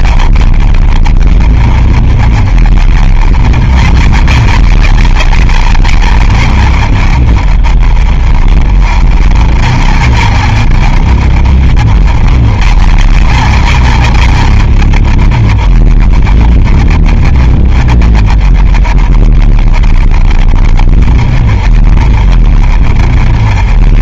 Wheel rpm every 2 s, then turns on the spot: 40, 30, 50, 50, 30, 50, 40, 40, 30, 30, 30, 30.
none